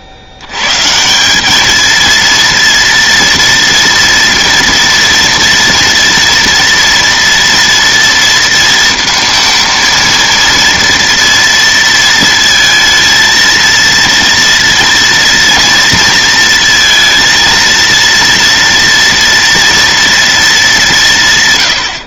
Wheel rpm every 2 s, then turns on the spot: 80, 230, 230, 230, 220, 230, 230, 230, 220, 230, 220.
none